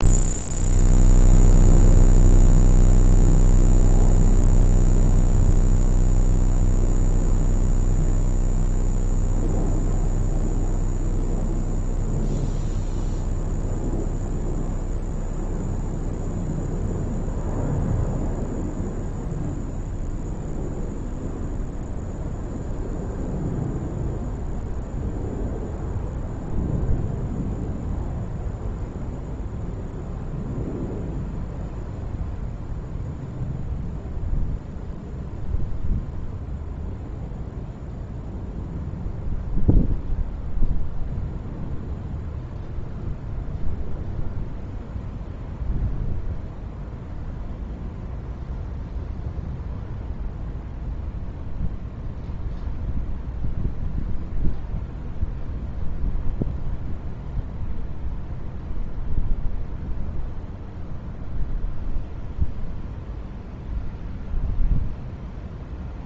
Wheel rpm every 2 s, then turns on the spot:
0, 0, 0, 0, 0, 0, 0, 0, 0, 0, 0, 0, 0, 0, 0, 0, 0, 0, 0, 0, 0, 0, 0, 0, 0, 0, 0, 0, 0, 0, 0, 0, 0.
none